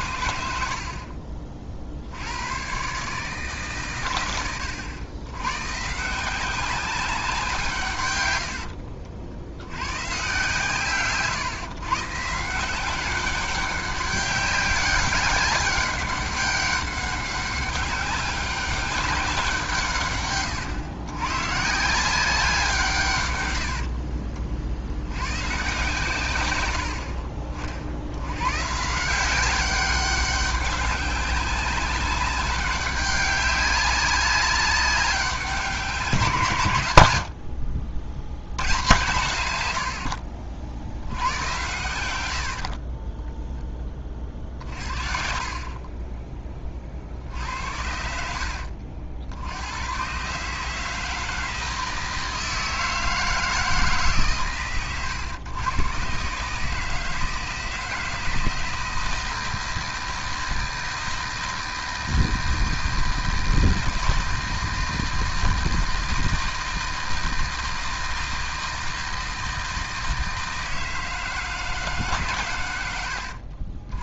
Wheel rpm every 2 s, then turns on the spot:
80, 110, 70, 180, 90, 130, 170, 200, 200, 200, 120, 180, 50, 110, 120, 200, 200, 200, 140, 90, 60, 60, 50, 30, 70, 140, 160, 140, 150, 160, 160, 160, 160, 160, 160, 160, 120.
8-10 42-44